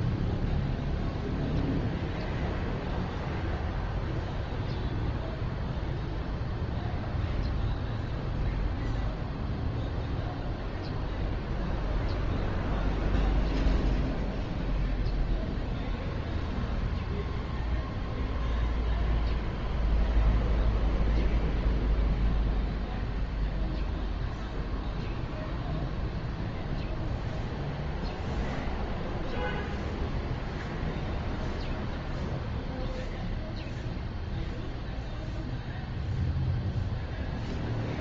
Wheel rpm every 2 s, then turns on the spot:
0, 0, 0, 0, 0, 0, 0, 0, 0, 0, 0, 0, 0, 0, 0, 0, 0, 0, 0.
none